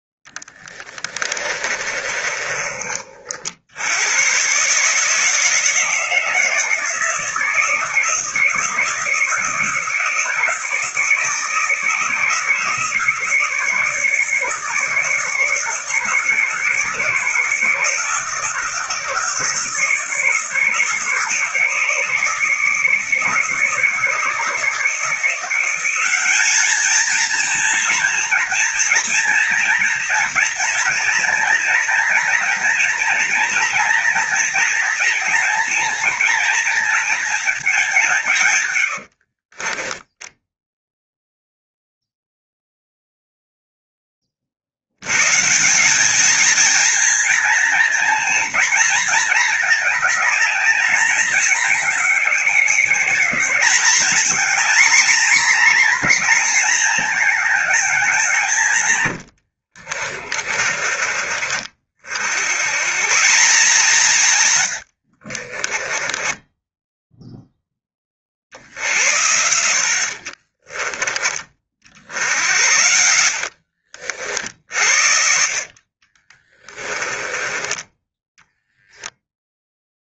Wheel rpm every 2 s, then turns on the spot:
10, 40, 150, 160, 160, 160, 160, 150, 150, 150, 150, 160, 160, 220, 240, 240, 230, 230, 230, 90, 0, 0, 80, 230, 230, 210, 190, 240, 230, 130, 40, 140, 90, 10, 70, 30, 80, 60, 20, 0.
0-2 38-40 60-62 64-68 70-74 76-78